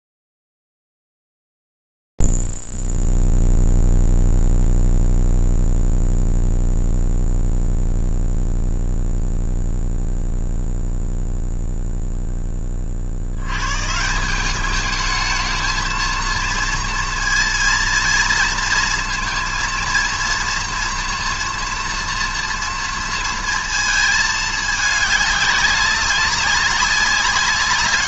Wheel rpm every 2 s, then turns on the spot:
0, 0, 0, 0, 0, 0, 0, 150, 220, 230, 230, 230, 220, 190.
none